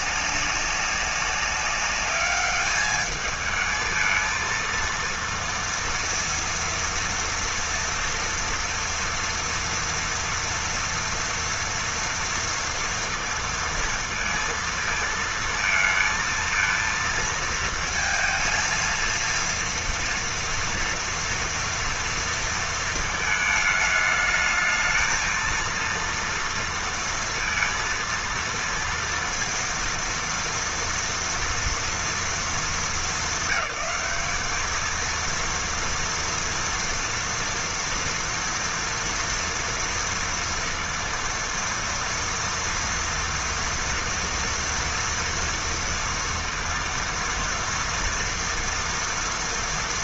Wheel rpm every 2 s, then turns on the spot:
190, 210, 230, 230, 230, 240, 230, 230, 230, 230, 230, 220, 220, 230, 230, 230, 200, 230, 230, 230, 230, 230, 230, 230, 230.
none